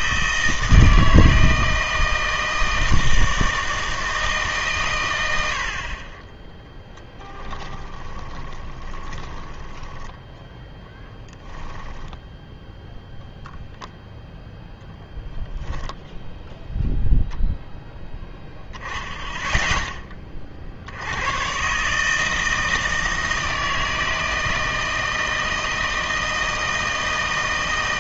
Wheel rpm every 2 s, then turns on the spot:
160, 160, 140, 10, 20, 10, 0, 0, 0, 10, 50, 160, 160, 160.
6-12